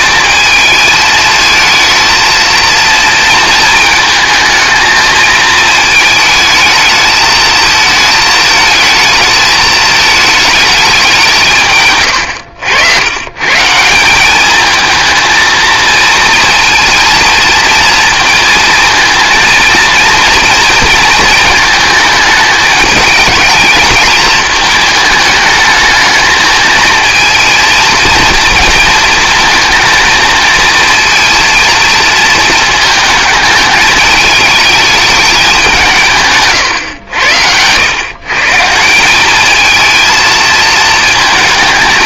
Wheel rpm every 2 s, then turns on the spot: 220, 230, 220, 220, 220, 210, 80, 210, 230, 230, 220, 210, 220, 220, 230, 230, 220, 220, 130, 160, 220.
none